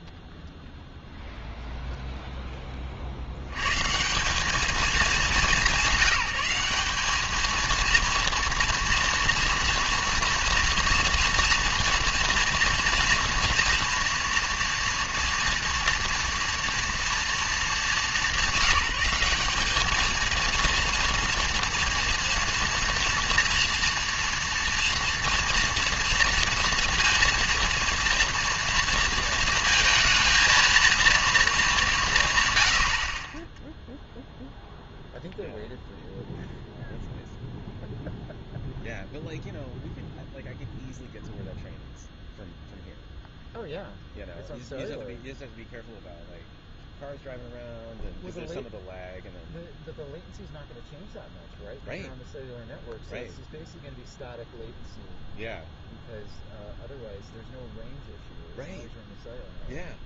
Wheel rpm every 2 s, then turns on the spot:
0, 20, 210, 190, 230, 230, 230, 230, 230, 200, 230, 240, 230, 230, 230, 230, 90, 0, 0, 0, 0, 0, 0, 0, 0, 0, 0, 0, 0, 0.
none